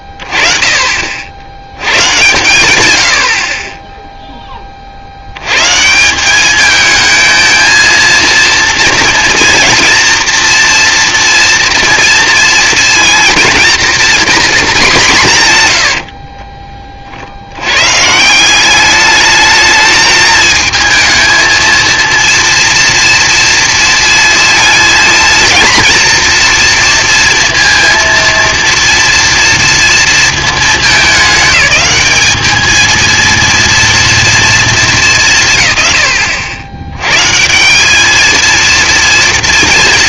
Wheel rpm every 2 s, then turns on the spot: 60, 80, 70, 220, 230, 230, 230, 170, 50, 210, 220, 230, 230, 230, 230, 200, 220, 230, 80, 230.
none